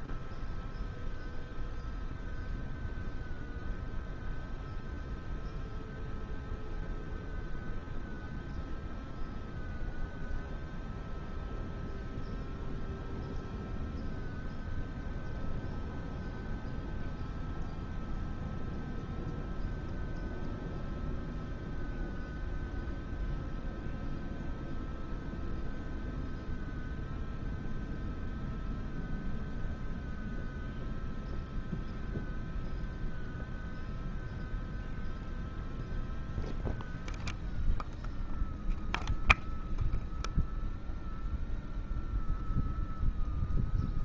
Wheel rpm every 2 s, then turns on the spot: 0, 0, 0, 0, 0, 0, 0, 0, 0, 0, 0, 0, 0, 0, 0, 0, 0, 0, 0, 0, 0, 0.
none